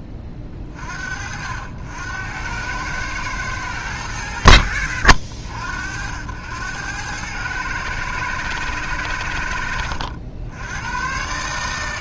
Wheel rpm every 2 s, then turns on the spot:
30, 90, 80, 90, 120, 100.
none